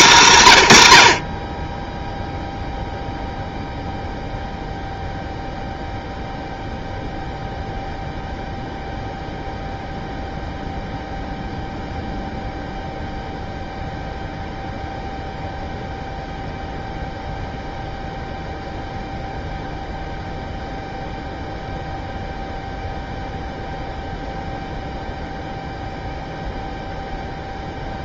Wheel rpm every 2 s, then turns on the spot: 110, 0, 0, 0, 0, 0, 0, 0, 0, 0, 0, 0, 0, 0.
none